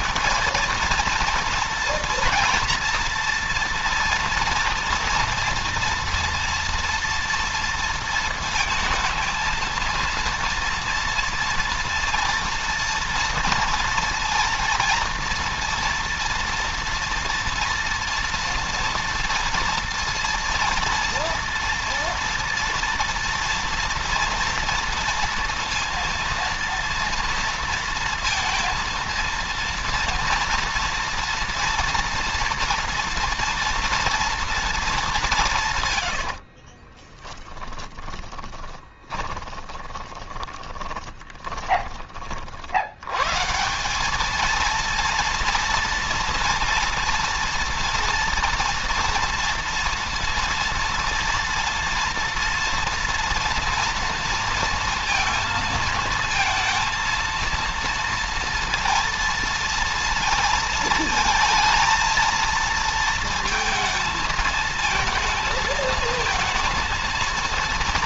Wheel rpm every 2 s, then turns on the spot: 220, 230, 230, 230, 230, 230, 230, 230, 230, 240, 230, 230, 230, 230, 230, 230, 240, 230, 60, 20, 20, 50, 210, 230, 230, 230, 230, 230, 230, 230, 230, 230, 220, 230.
36-42